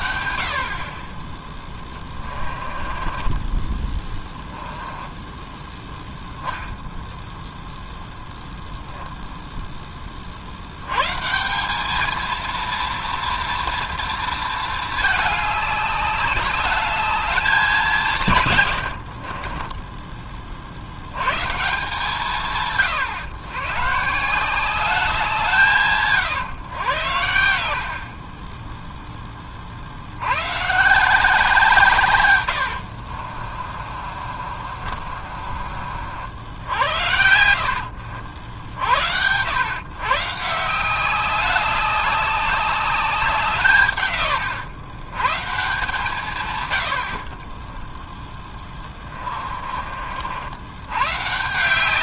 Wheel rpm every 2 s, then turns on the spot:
50, 20, 10, 0, 0, 70, 230, 220, 200, 110, 60, 140, 180, 110, 10, 130, 90, 50, 70, 70, 160, 200, 120, 120, 10, 90.
2-6 32-36 48-50